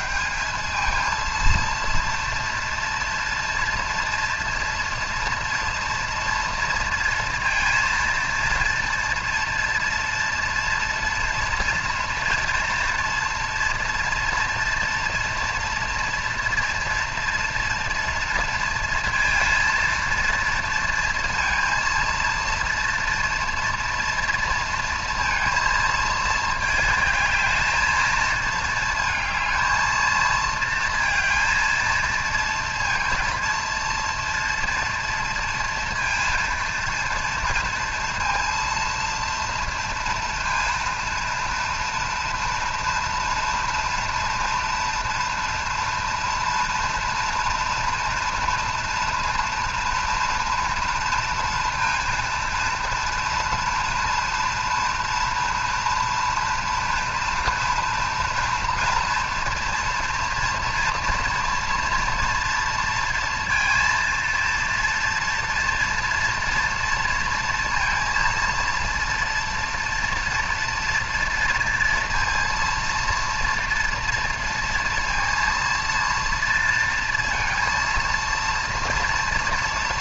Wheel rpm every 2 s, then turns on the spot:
230, 230, 230, 230, 240, 230, 230, 230, 230, 230, 230, 230, 230, 220, 220, 230, 230, 230, 230, 230, 230, 230, 240, 230, 230, 230, 230, 240, 230, 240, 230, 230, 230, 230, 230, 230, 230, 230, 230, 230.
none